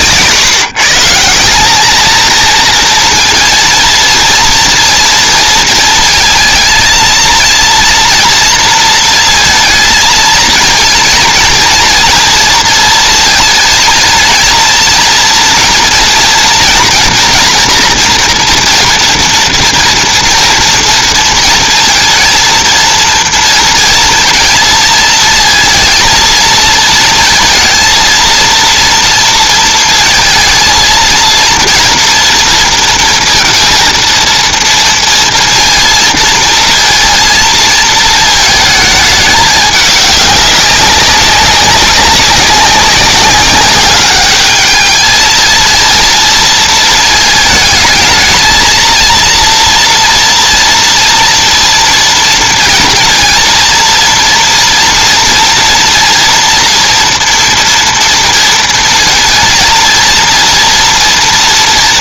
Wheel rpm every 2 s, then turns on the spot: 140, 230, 230, 230, 230, 220, 230, 230, 230, 230, 230, 230, 230, 230, 230, 230, 230, 230, 230, 220, 200, 200, 210, 230, 220, 230, 230, 230, 230, 230, 230.
none